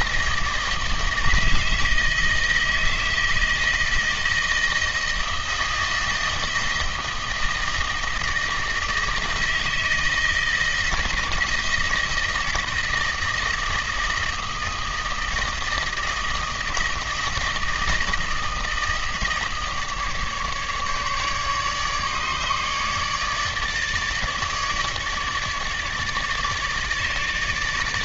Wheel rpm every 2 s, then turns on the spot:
160, 160, 160, 160, 160, 160, 160, 160, 160, 160, 150, 150, 150, 150.
none